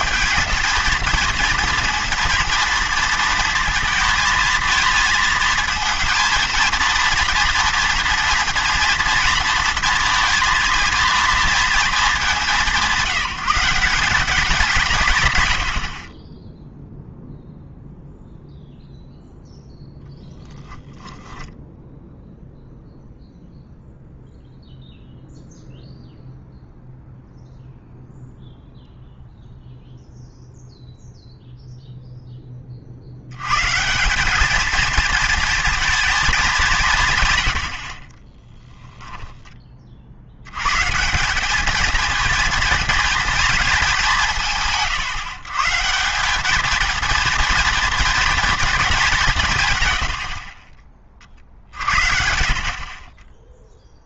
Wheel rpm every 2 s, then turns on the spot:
220, 230, 230, 220, 230, 230, 190, 190, 10, 0, 10, 0, 0, 0, 0, 0, 30, 210, 200, 20, 110, 230, 150, 220, 220, 40, 50.
20-22 38-40 50-52